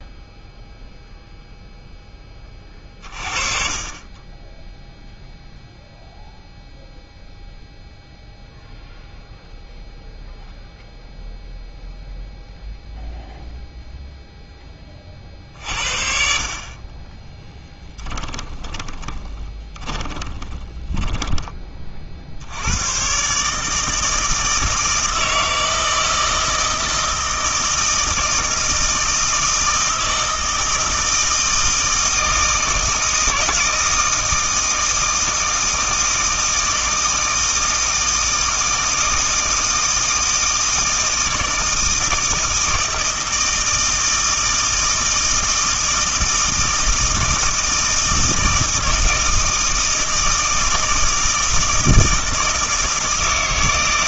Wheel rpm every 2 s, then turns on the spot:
0, 30, 0, 0, 0, 0, 0, 20, 30, 20, 20, 100, 160, 160, 160, 160, 160, 160, 160, 160, 160, 160, 160, 160, 160, 160, 160.
18-22